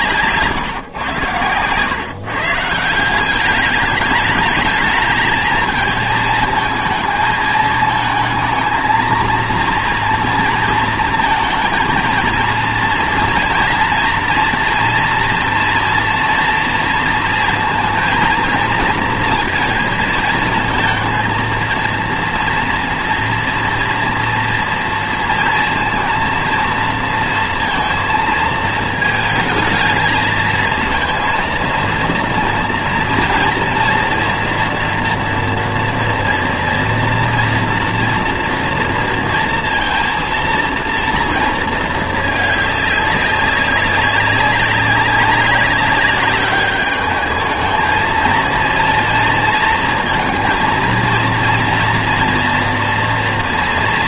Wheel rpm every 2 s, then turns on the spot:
140, 150, 210, 220, 230, 230, 230, 230, 230, 230, 230, 230, 230, 230, 220, 230, 230, 230, 230, 230, 230, 210, 200, 200, 230, 230, 240.
none